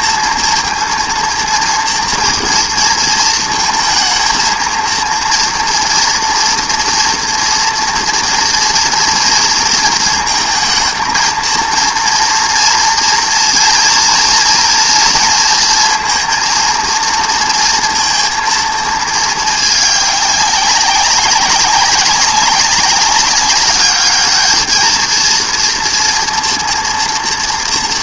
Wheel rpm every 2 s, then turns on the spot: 230, 230, 220, 230, 230, 230, 230, 230, 230, 230, 200, 190, 210, 240.
none